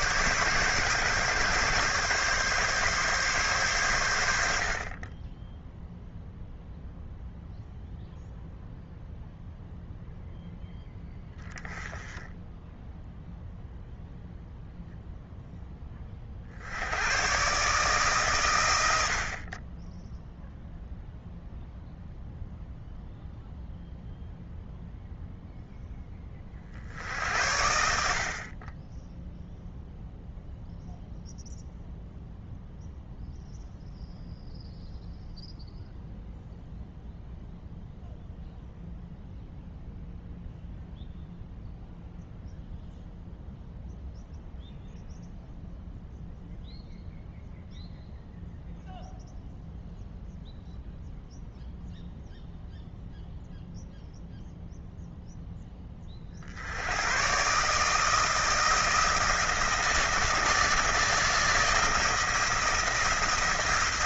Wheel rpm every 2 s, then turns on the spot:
140, 140, 50, 0, 0, 0, 10, 0, 70, 110, 0, 0, 0, 40, 40, 0, 0, 0, 0, 0, 0, 0, 0, 0, 0, 0, 0, 0, 70, 160, 160, 170.
none